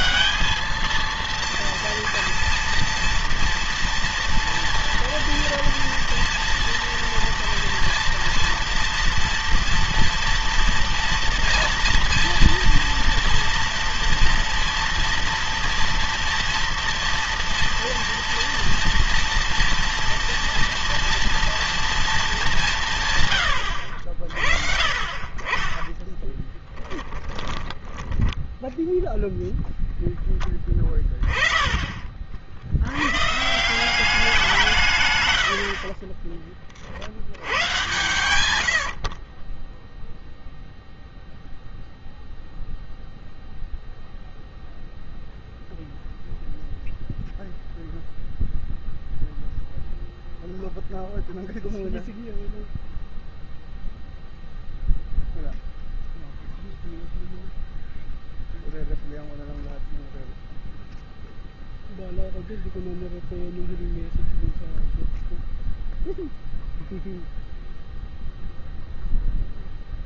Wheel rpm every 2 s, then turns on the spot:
220, 230, 230, 230, 240, 240, 230, 230, 230, 230, 230, 170, 40, 10, 10, 20, 80, 170, 50, 80, 0, 0, 0, 0, 0, 0, 0, 0, 0, 0, 0, 0, 0, 0, 0.
26-30 38-40